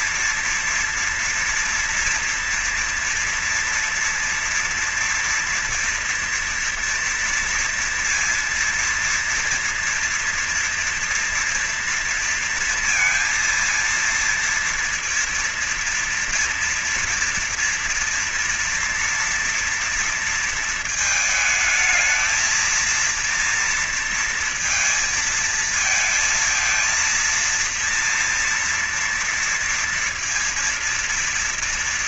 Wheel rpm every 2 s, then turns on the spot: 240, 240, 230, 230, 230, 230, 230, 230, 230, 230, 230, 220, 230, 230, 230, 230.
none